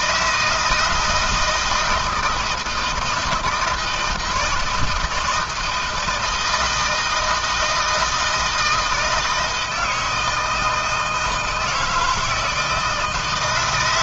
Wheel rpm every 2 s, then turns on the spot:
160, 170, 160, 160, 160, 160, 160.
none